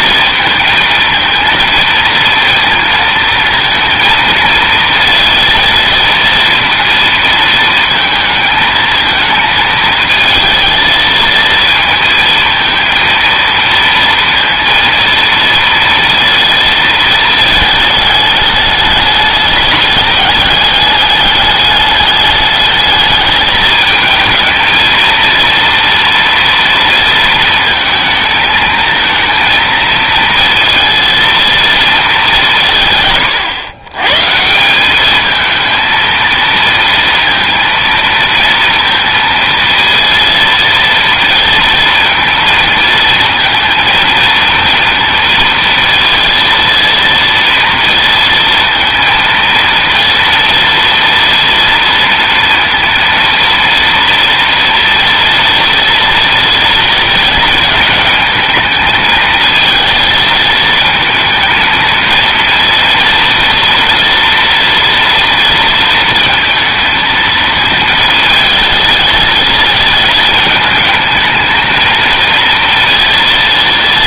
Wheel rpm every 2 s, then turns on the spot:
220, 230, 230, 230, 220, 220, 230, 230, 230, 210, 210, 210, 220, 230, 220, 230, 150, 180, 230, 230, 230, 230, 230, 230, 230, 230, 230, 230, 230, 220, 230, 230, 230, 230, 220, 220, 230.
none